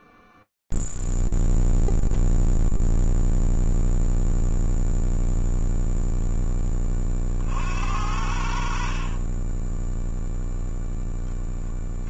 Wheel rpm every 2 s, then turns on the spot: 0, 0, 0, 10, 60, 0.
none